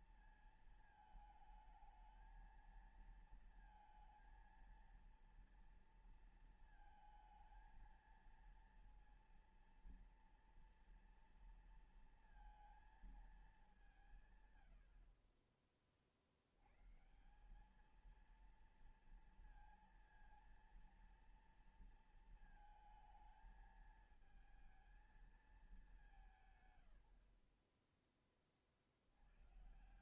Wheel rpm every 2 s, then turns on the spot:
220, 220, 230, 230, 230, 230, 230, 140, 60, 220, 230, 230, 220, 160, 20.
none